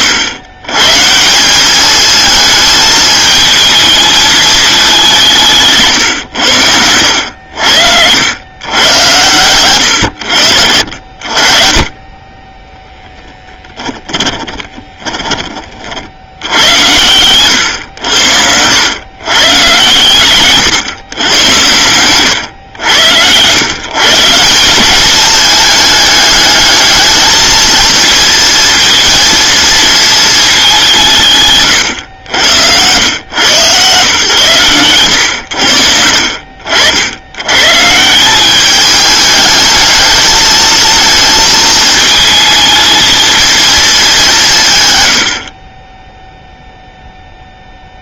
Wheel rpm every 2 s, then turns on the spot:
130, 220, 210, 90, 120, 70, 10, 20, 90, 100, 130, 100, 200, 220, 230, 190, 90, 110, 70, 200, 220, 220, 130, 0.
12-16